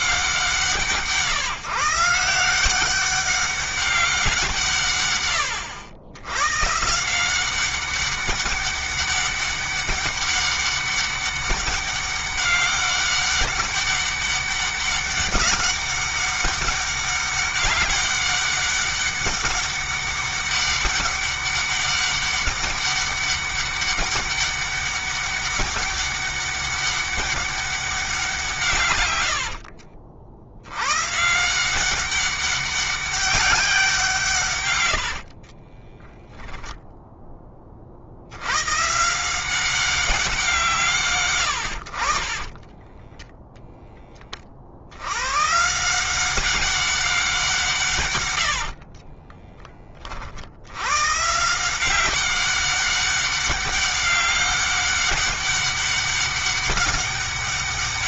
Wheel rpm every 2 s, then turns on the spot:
180, 180, 150, 150, 200, 200, 200, 200, 200, 200, 200, 200, 200, 200, 120, 100, 200, 110, 10, 120, 170, 20, 70, 190, 60, 100, 200, 200, 200.
34-36 42-44 48-50